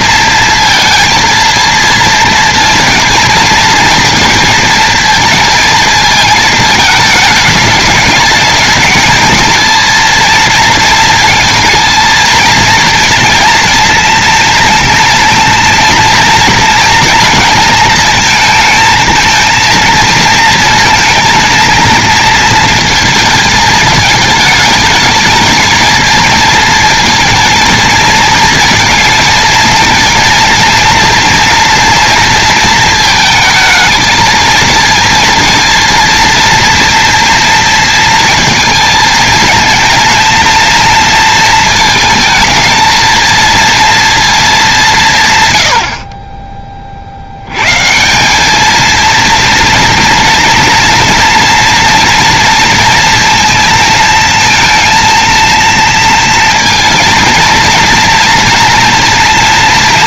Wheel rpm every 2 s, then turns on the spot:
230, 230, 230, 220, 210, 230, 230, 230, 230, 230, 230, 230, 210, 220, 220, 230, 230, 230, 230, 220, 230, 220, 200, 20, 210, 230, 230, 230, 230, 230.
none